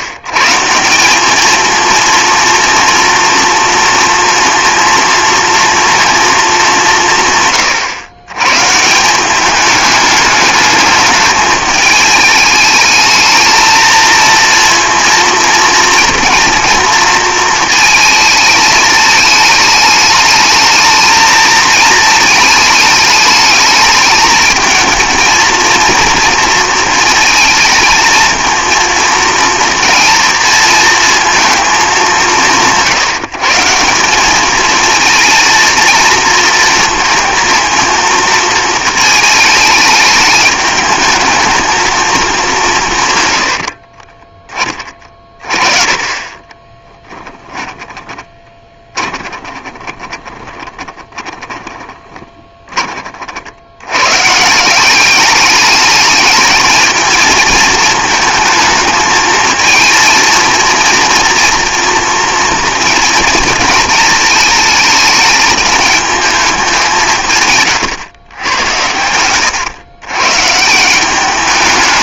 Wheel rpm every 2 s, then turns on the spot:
150, 230, 230, 220, 130, 210, 210, 230, 240, 220, 220, 220, 220, 230, 230, 220, 170, 210, 230, 230, 210, 190, 20, 20, 20, 20, 20, 150, 220, 220, 230, 230, 220, 210, 110, 140.
46-52